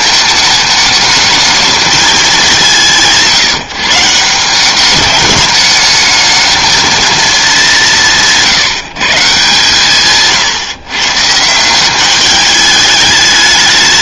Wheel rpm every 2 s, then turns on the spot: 220, 190, 190, 220, 170, 140, 210.
none